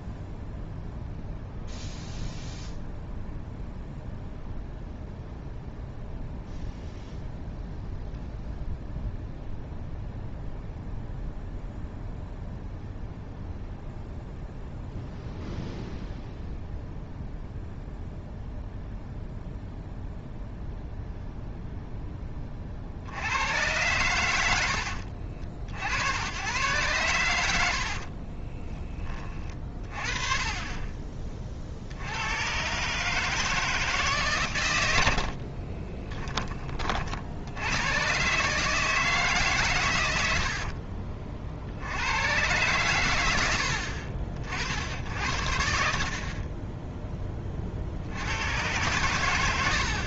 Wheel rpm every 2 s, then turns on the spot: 0, 0, 0, 0, 0, 0, 0, 0, 0, 0, 0, 70, 80, 110, 30, 30, 140, 80, 40, 150, 40, 110, 70, 10, 100.
40-42